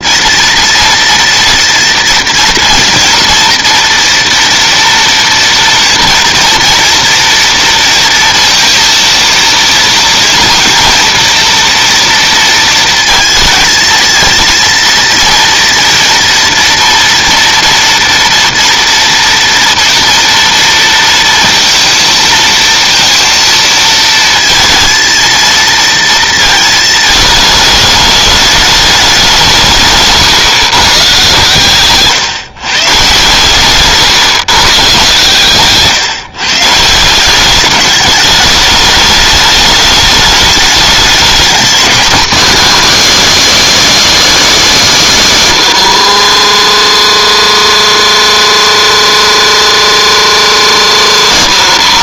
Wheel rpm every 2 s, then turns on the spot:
230, 230, 230, 240, 230, 230, 230, 230, 230, 230, 230, 230, 230, 220, 210, 120, 140, 140, 150, 210, 210, 270, 250, 60, 60, 70.
46-52